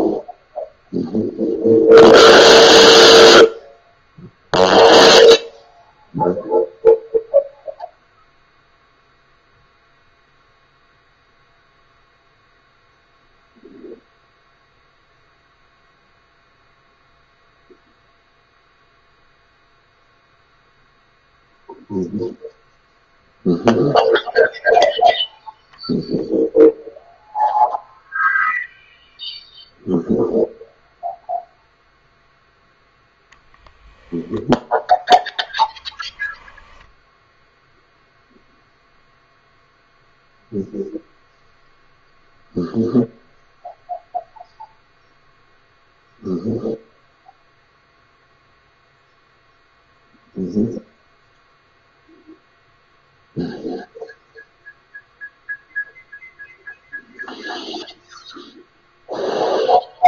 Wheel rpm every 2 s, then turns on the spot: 0, 0, 0, 0, 0, 0, 0, 0, 0, 0, 0, 0, 0, 0, 0, 0, 0, 0, 10, 0, 0, 0, 0, 0, 0, 0, 0, 0, 0, 0.
none